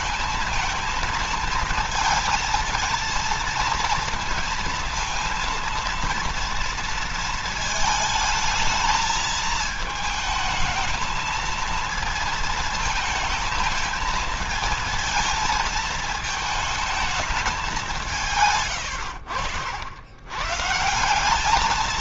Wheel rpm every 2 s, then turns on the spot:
220, 230, 230, 230, 220, 220, 220, 220, 220, 110, 160.
none